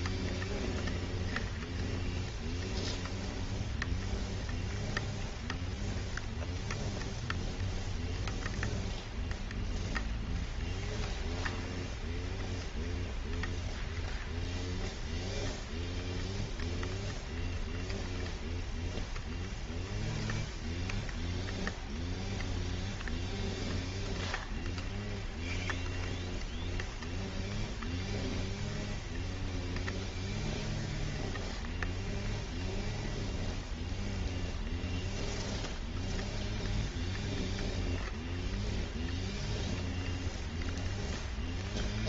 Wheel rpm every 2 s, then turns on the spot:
0, 0, 0, 0, 0, 0, 0, 0, 0, 0, 0, 0, 0, 0, 0, 0, 0, 0, 0, 0, 0.
none